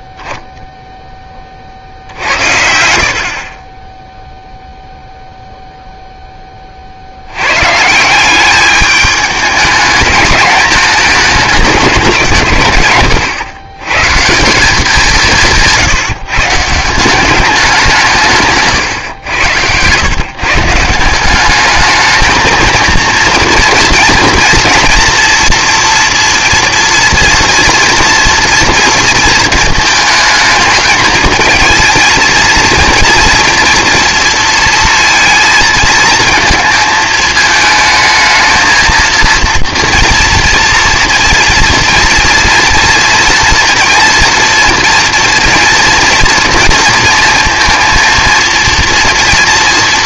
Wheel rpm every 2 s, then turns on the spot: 0, 70, 0, 70, 210, 220, 120, 180, 180, 120, 180, 230, 230, 240, 230, 220, 230, 230, 220, 230, 230, 230, 230, 230, 230.
none